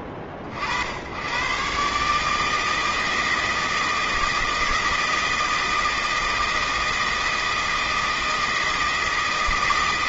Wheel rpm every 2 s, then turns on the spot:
70, 160, 160, 160, 160.
none